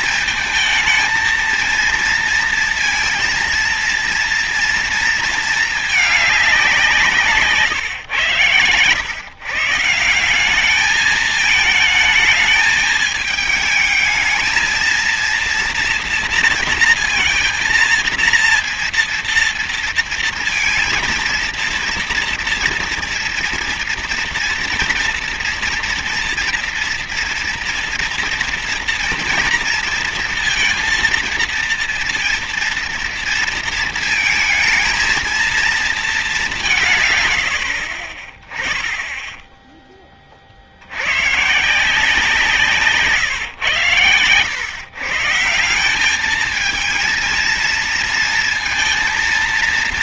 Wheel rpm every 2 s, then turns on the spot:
230, 230, 230, 200, 110, 190, 220, 220, 230, 230, 230, 230, 230, 230, 230, 230, 230, 230, 200, 20, 30, 170, 120, 210, 230.
none